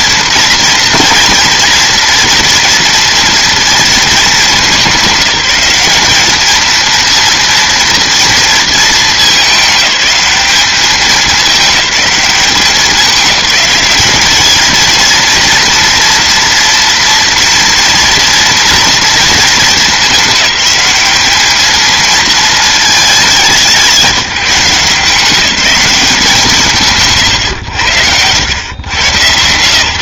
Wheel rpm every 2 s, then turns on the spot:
230, 230, 200, 230, 220, 210, 200, 220, 230, 230, 210, 220, 170, 150, 110.
none